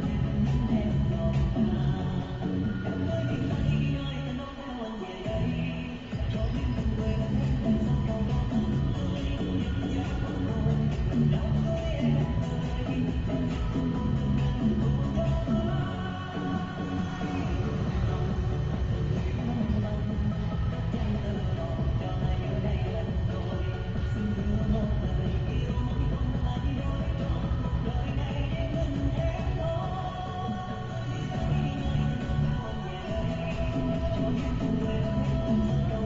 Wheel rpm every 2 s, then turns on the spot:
0, 0, 0, 0, 0, 0, 0, 0, 0, 0, 0, 0, 0, 0, 0, 0, 0, 0.
none